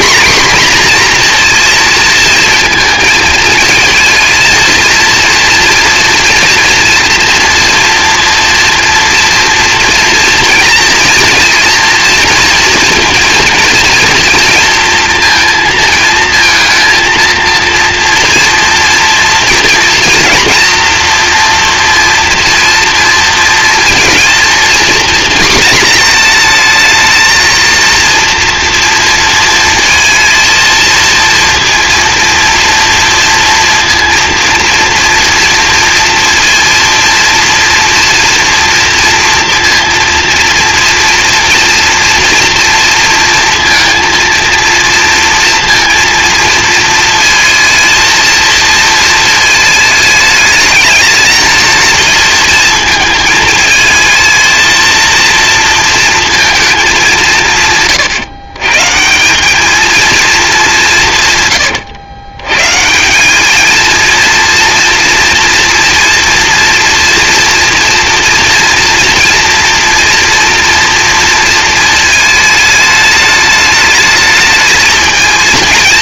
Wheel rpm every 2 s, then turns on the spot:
250, 230, 230, 240, 230, 230, 230, 230, 230, 230, 230, 230, 230, 220, 230, 220, 230, 230, 230, 230, 230, 230, 230, 230, 220, 210, 220, 230, 190, 150, 170, 160, 230, 230, 230, 230, 210, 220.
none